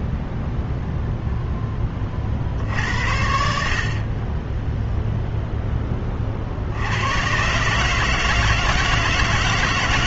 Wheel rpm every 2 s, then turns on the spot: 0, 70, 10, 60, 160.
none